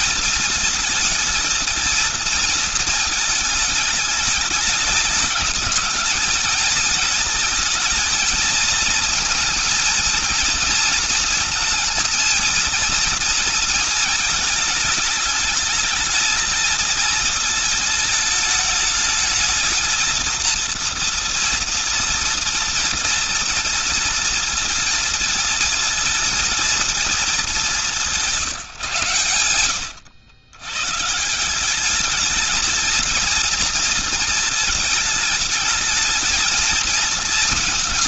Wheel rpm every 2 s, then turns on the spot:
230, 220, 210, 220, 230, 230, 230, 210, 220, 210, 230, 230, 230, 230, 140, 120, 230, 220, 220.
none